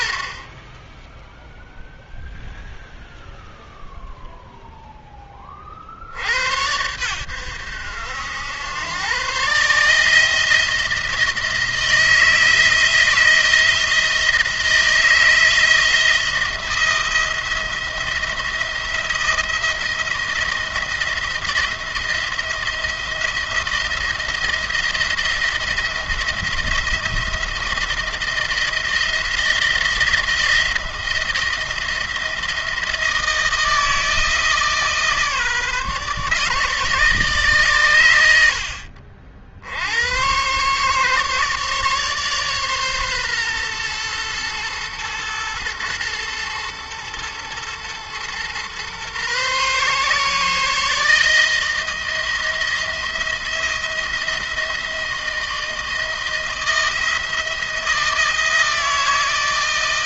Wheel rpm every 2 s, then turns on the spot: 40, 0, 0, 80, 90, 160, 170, 160, 170, 170, 170, 170, 170, 170, 170, 160, 160, 160, 150, 80, 130, 140, 120, 110, 120, 150, 170, 170, 170, 160.
none